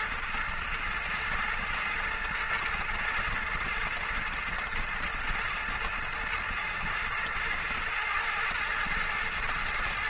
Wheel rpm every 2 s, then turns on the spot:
110, 110, 110, 110, 110.
none